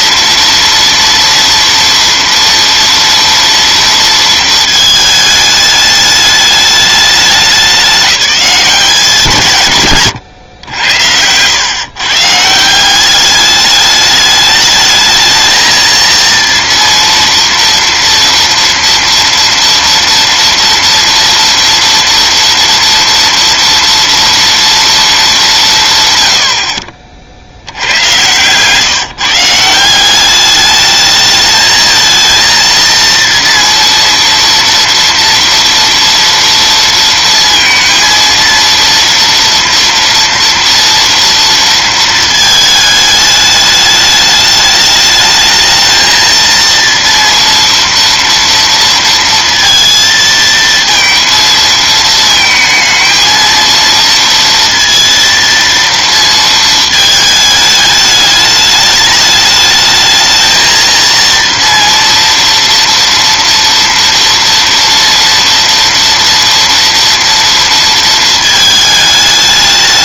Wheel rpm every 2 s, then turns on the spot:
230, 230, 220, 210, 190, 90, 180, 220, 230, 230, 230, 230, 230, 40, 140, 210, 230, 230, 230, 230, 230, 220, 210, 230, 230, 230, 220, 230, 220, 210, 230, 230, 230, 230, 220.
none